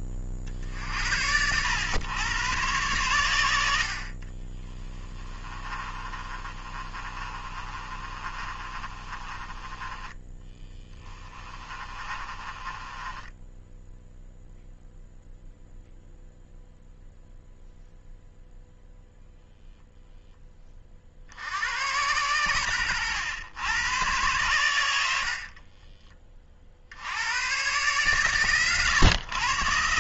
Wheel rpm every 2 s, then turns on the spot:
40, 110, 20, 30, 30, 10, 20, 0, 0, 0, 20, 90, 100, 70, 130.
4-14